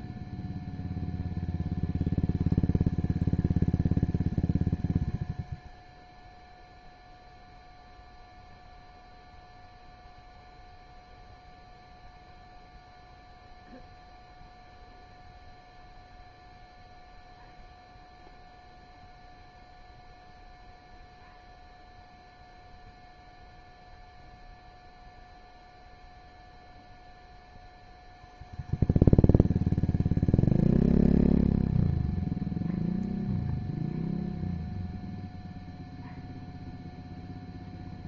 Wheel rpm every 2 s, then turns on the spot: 0, 0, 0, 0, 0, 0, 0, 0, 0, 0, 0, 0, 0, 0, 0, 0, 0, 0, 0.
none